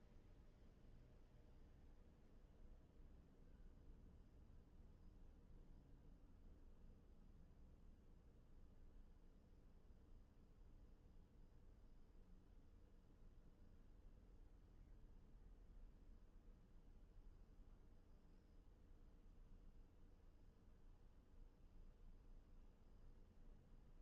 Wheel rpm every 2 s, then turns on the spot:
0, 0, 0, 0, 0, 0, 0, 0, 0, 0, 0, 0.
none